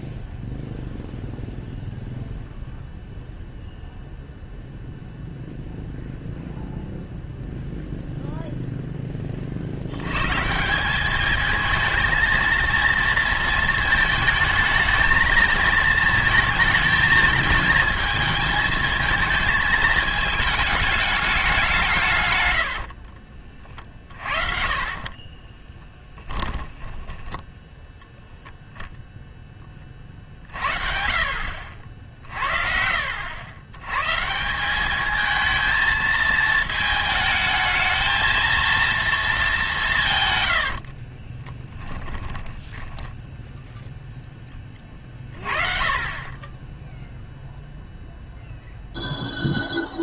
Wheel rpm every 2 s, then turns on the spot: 0, 0, 0, 0, 0, 160, 230, 220, 220, 220, 210, 90, 50, 10, 0, 50, 50, 180, 220, 230, 90, 10, 20, 10, 0.
22-28 40-44